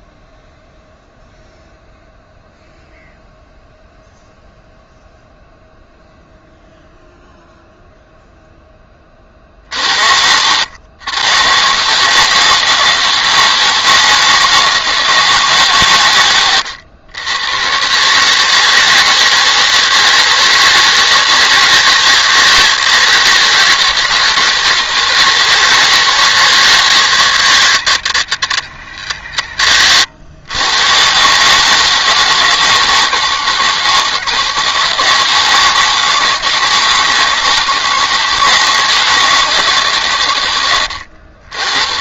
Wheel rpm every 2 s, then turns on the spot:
0, 0, 0, 0, 0, 90, 150, 160, 120, 150, 160, 160, 170, 160, 150, 100, 160, 160, 160, 160, 100.
none